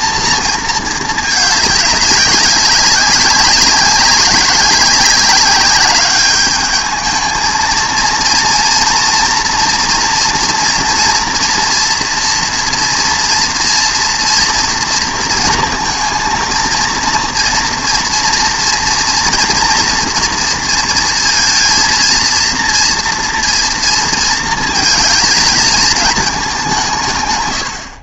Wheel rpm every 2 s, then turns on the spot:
220, 200, 190, 210, 230, 240, 230, 230, 230, 230, 230, 230, 220, 180.
none